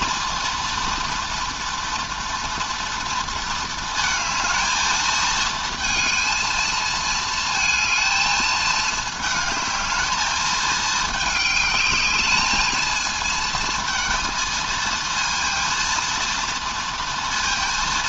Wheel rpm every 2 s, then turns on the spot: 230, 230, 220, 230, 220, 210, 220, 230, 230.
none